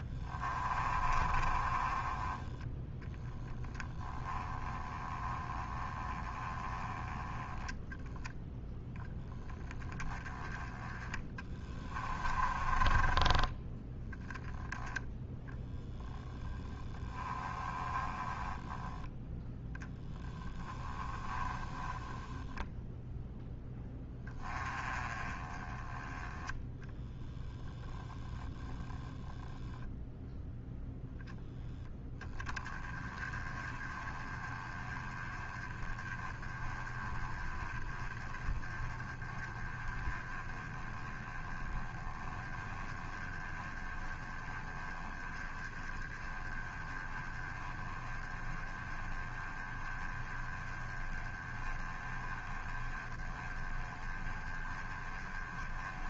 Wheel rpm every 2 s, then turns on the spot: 30, 10, 20, 10, 0, 10, 20, 10, 10, 10, 10, 0, 20, 10, 10, 0, 20, 20, 20, 20, 20, 20, 20, 20, 20, 20, 20, 20.
0-2 10-14 16-22 28-30